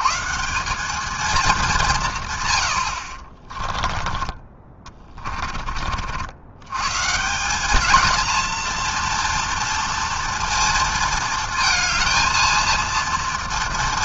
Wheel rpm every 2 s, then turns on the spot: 210, 40, 30, 170, 230, 230, 230.
2-6